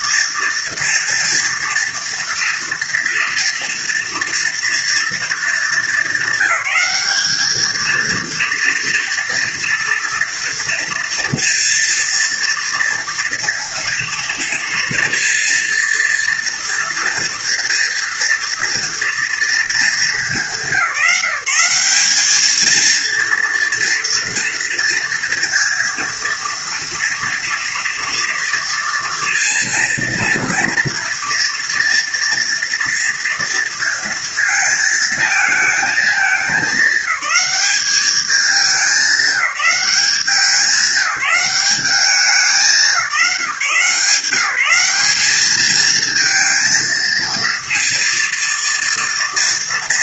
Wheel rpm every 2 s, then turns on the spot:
230, 230, 230, 200, 230, 230, 230, 230, 230, 230, 180, 220, 230, 230, 230, 230, 230, 220, 200, 210, 190, 180, 180, 230, 230.
none